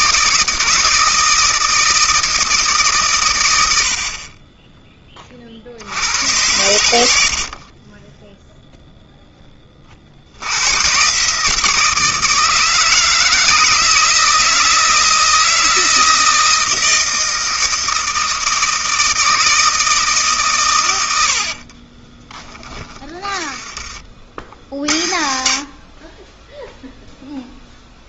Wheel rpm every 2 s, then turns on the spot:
160, 160, 30, 90, 0, 90, 160, 160, 160, 160, 140, 20, 60, 10.
22-24